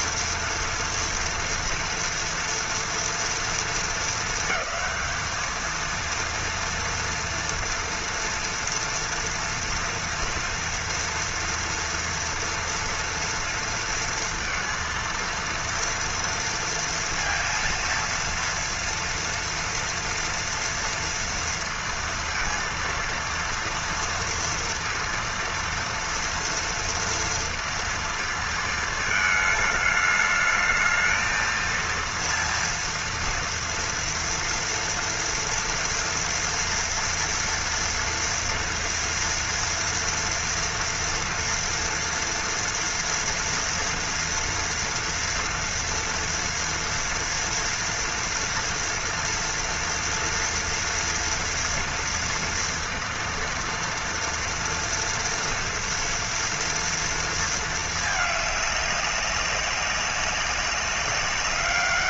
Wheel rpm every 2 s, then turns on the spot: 230, 240, 220, 230, 230, 240, 230, 230, 230, 230, 230, 230, 230, 230, 220, 220, 230, 230, 240, 230, 230, 230, 230, 230, 230, 230, 230, 230, 230, 200, 200.
none